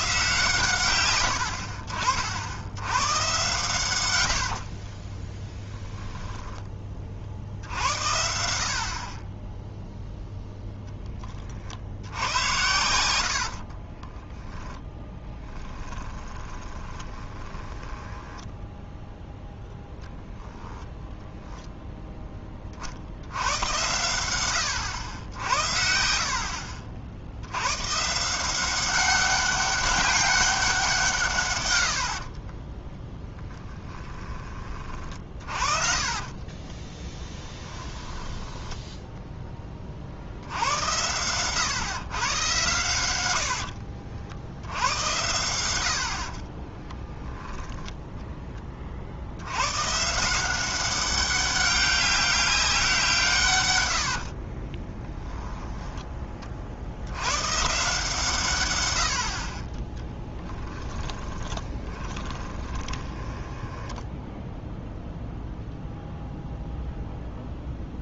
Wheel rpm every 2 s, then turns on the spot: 130, 90, 60, 10, 60, 0, 90, 10, 20, 10, 10, 30, 100, 70, 190, 190, 30, 30, 30, 10, 90, 110, 80, 30, 20, 190, 190, 40, 40, 120, 10, 20, 0, 0.
4-6 14-20 26-28 32-34 36-40 46-48 54-56 60-64